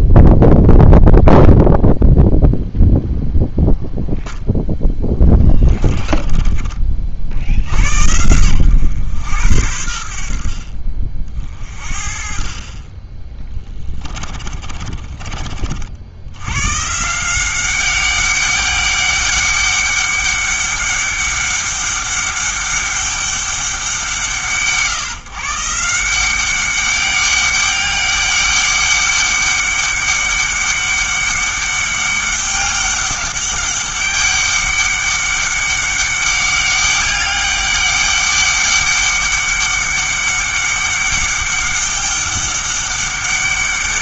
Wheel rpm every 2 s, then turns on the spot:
0, 0, 0, 30, 100, 50, 40, 40, 140, 200, 200, 200, 150, 200, 200, 200, 200, 200, 200, 200, 200, 200.
14-16